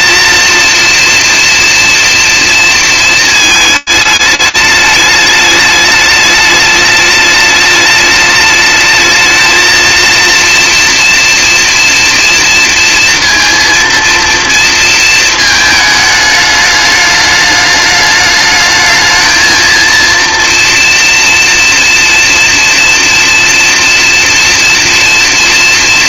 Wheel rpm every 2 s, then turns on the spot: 240, 230, 210, 210, 220, 230, 230, 230, 210, 210, 230, 230, 230.
none